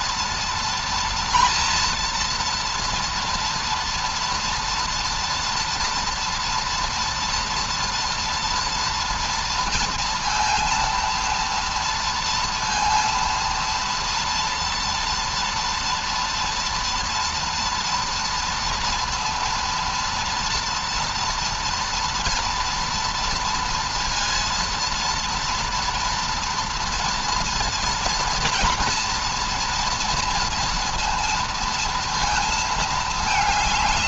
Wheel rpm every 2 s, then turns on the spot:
230, 240, 230, 230, 230, 230, 230, 230, 230, 230, 230, 230, 230, 230, 230, 230, 220.
none